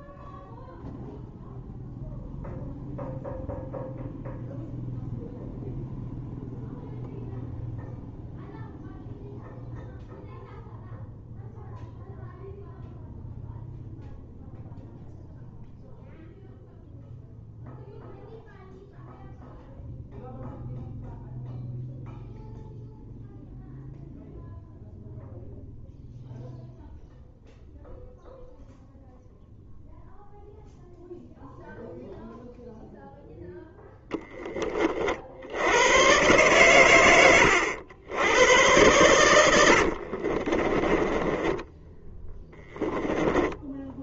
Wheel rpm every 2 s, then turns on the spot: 0, 0, 0, 0, 0, 0, 0, 0, 0, 0, 0, 0, 0, 0, 0, 0, 0, 40, 110, 100, 20, 10.
40-44